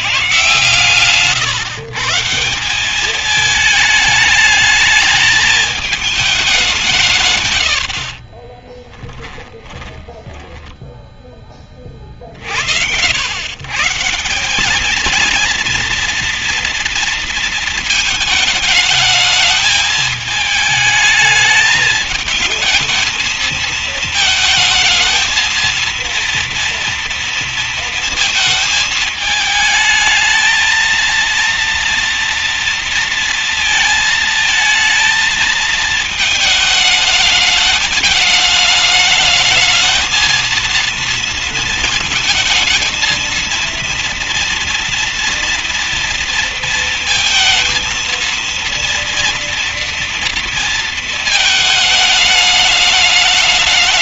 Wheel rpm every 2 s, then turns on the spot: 140, 170, 210, 200, 30, 10, 50, 180, 230, 220, 220, 220, 220, 230, 230, 230, 230, 220, 220, 210, 230, 220, 230, 230, 230, 230, 210.
8-12